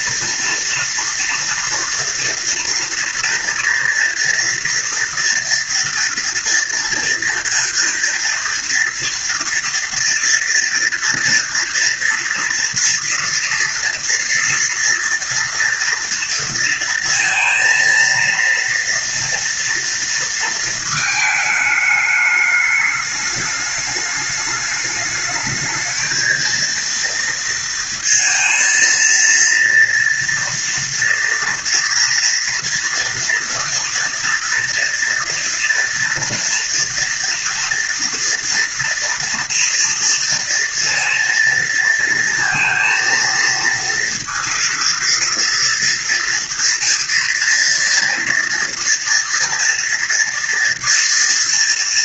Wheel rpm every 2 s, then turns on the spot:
230, 230, 230, 230, 230, 230, 230, 230, 230, 230, 230, 210, 210, 230, 230, 230, 230, 230, 230, 230, 230, 230, 230, 230, 230, 230.
none